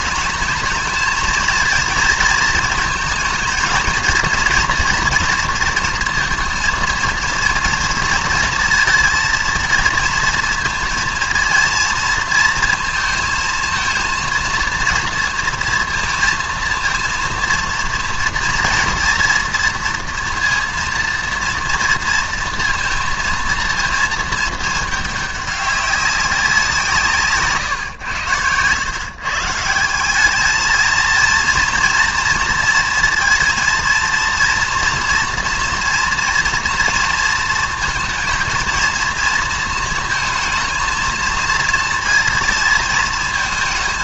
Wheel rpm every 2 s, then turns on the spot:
220, 230, 230, 230, 220, 230, 230, 230, 230, 230, 230, 230, 220, 180, 100, 210, 230, 230, 230, 230, 220, 230.
none